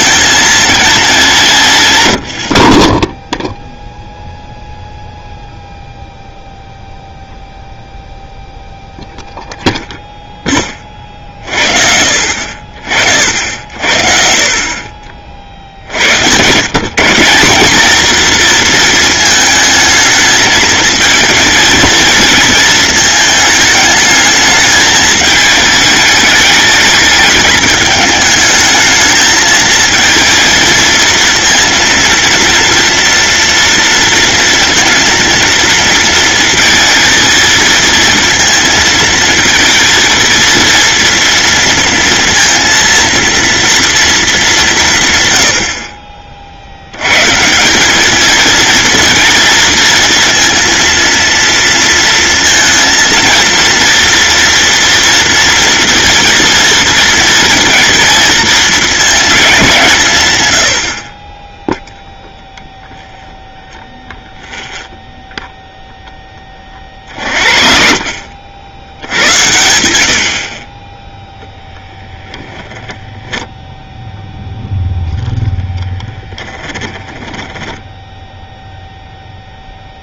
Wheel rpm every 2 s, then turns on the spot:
220, 30, 0, 0, 0, 30, 50, 30, 150, 230, 220, 230, 220, 210, 220, 230, 230, 230, 230, 230, 230, 230, 160, 90, 230, 230, 230, 230, 230, 220, 60, 0, 0, 40, 80, 30, 20, 0, 20, 0.
72-74 76-78